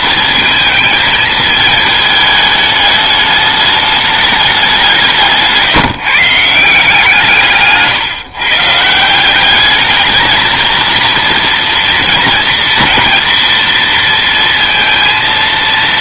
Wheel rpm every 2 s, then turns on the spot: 220, 210, 190, 160, 150, 230, 230, 230.
none